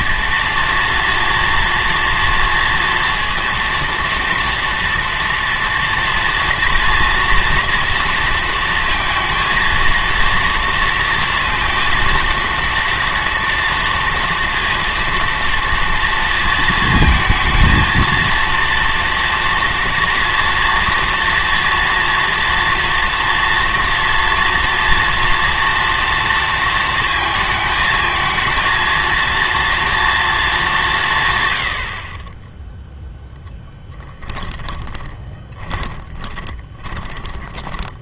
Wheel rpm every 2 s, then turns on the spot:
230, 230, 230, 230, 230, 230, 230, 230, 230, 230, 230, 240, 240, 230, 230, 190, 0, 20, 10.
34-38